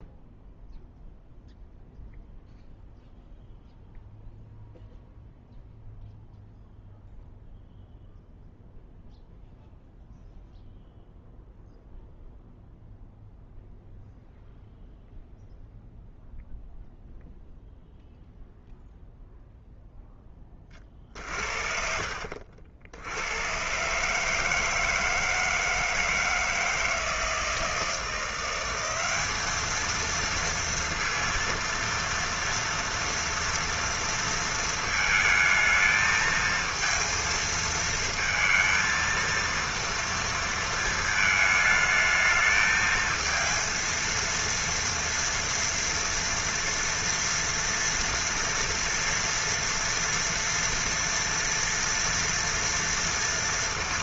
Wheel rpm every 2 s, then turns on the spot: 0, 0, 0, 0, 0, 0, 0, 0, 0, 0, 20, 70, 160, 160, 180, 230, 230, 220, 230, 230, 230, 220, 230, 230, 230, 230, 230.
none